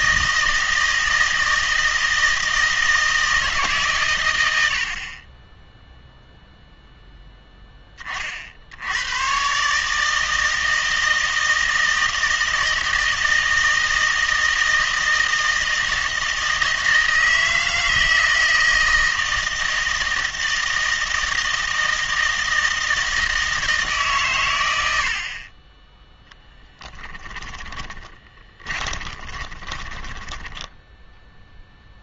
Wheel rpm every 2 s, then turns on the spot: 160, 160, 80, 0, 80, 160, 160, 160, 160, 160, 160, 160, 90, 10, 20, 10.
28-30